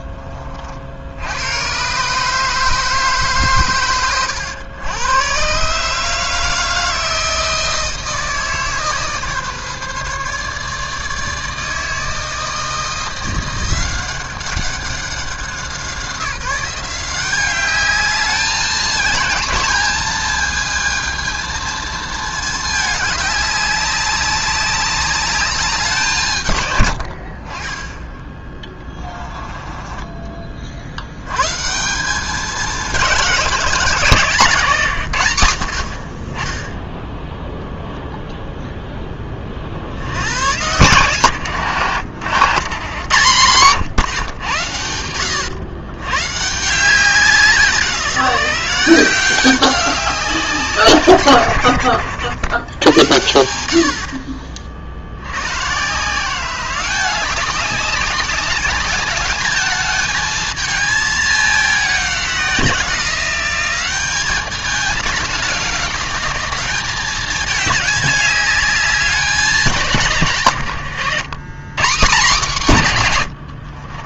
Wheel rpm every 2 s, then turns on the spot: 60, 150, 90, 160, 150, 150, 170, 190, 180, 220, 220, 210, 200, 110, 20, 60, 200, 150, 0, 10, 100, 120, 90, 170, 170, 150, 90, 60, 190, 200, 220, 180, 200, 200, 200, 130, 150.
28-30